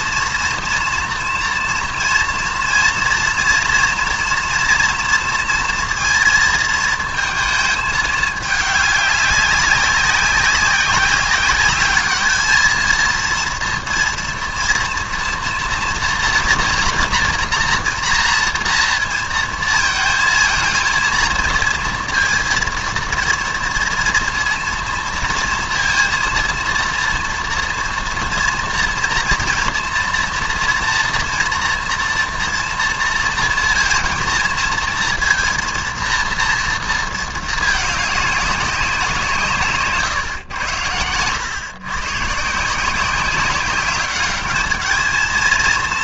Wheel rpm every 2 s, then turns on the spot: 240, 230, 230, 230, 200, 190, 220, 240, 230, 230, 230, 230, 230, 230, 230, 230, 240, 230, 230, 200, 100, 150, 210.
none